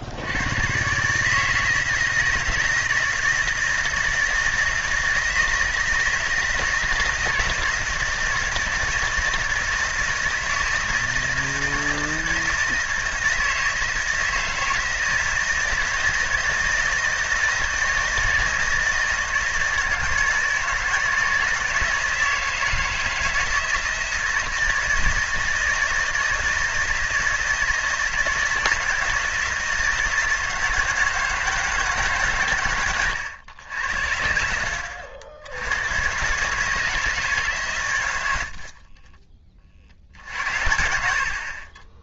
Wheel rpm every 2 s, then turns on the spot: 120, 170, 160, 160, 160, 160, 160, 160, 160, 160, 160, 160, 160, 160, 160, 160, 120, 70, 150, 50, 60.
none